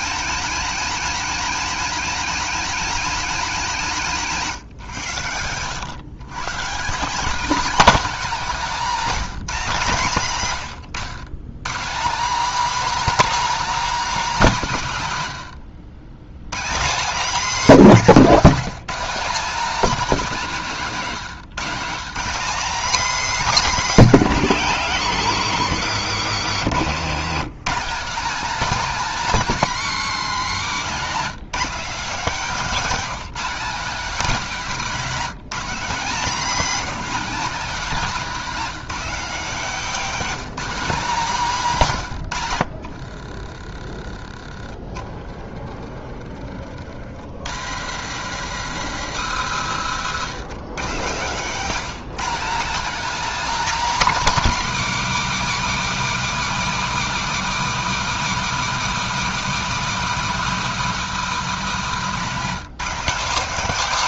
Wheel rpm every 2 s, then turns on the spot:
230, 230, 120, 200, 220, 130, 300, 170, 230, 230, 180, 270, 200, 150, 260, 200, 230, 230, 250, 240, 240, 60, 30, 60, 140, 170, 270, 260, 260, 250, 240, 220.
26-28 42-44 50-52